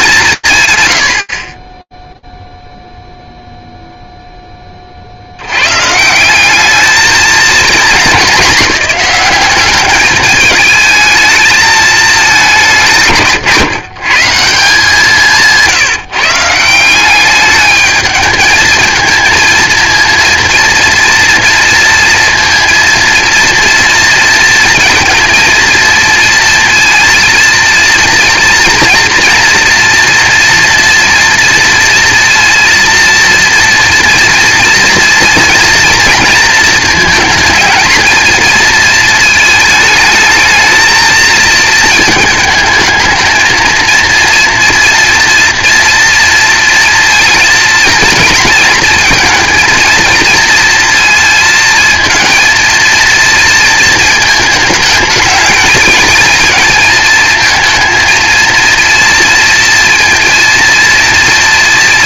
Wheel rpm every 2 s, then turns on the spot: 120, 0, 20, 200, 190, 220, 180, 160, 180, 220, 230, 230, 230, 230, 230, 240, 230, 230, 230, 230, 220, 220, 240, 230, 230, 230, 230, 220, 220, 230, 230.
none